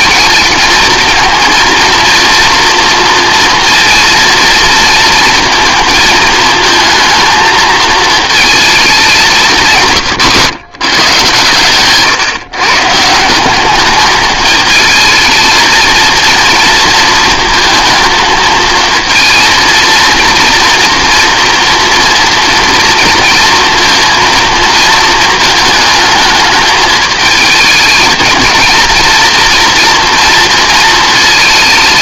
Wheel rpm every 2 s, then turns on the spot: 220, 230, 220, 220, 210, 130, 150, 220, 230, 220, 230, 230, 230, 220, 220, 230.
none